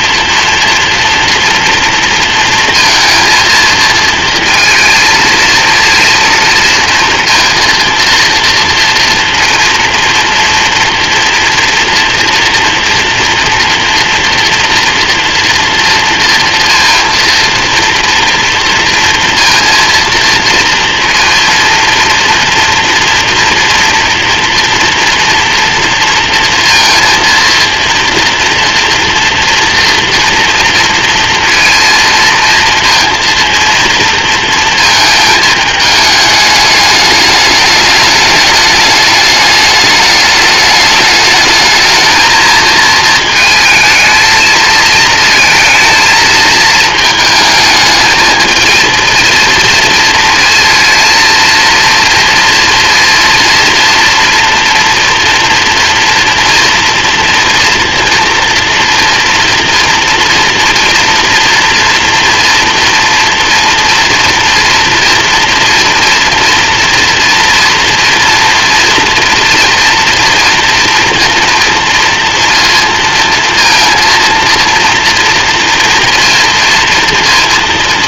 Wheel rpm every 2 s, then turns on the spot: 230, 230, 230, 230, 230, 240, 240, 230, 230, 230, 230, 240, 230, 230, 240, 230, 230, 220, 210, 210, 220, 220, 220, 220, 230, 230, 230, 230, 230, 230, 240, 240, 230, 230, 230, 230, 230, 230, 230.
none